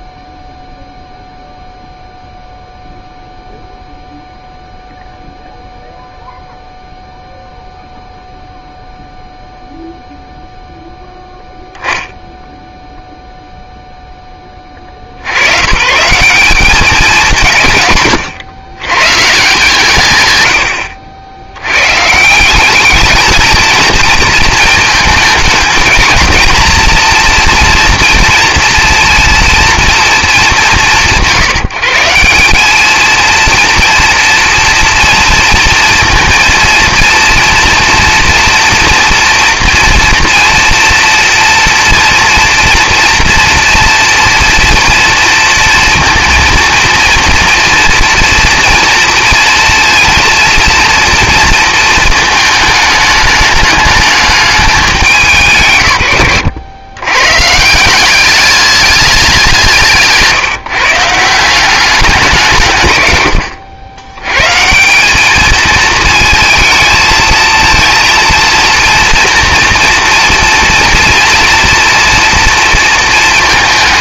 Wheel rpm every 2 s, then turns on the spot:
0, 0, 0, 0, 0, 0, 0, 100, 140, 170, 110, 230, 220, 230, 230, 160, 240, 230, 230, 240, 230, 230, 230, 230, 230, 230, 210, 130, 140, 180, 180, 100, 210, 220, 240, 230, 230.
none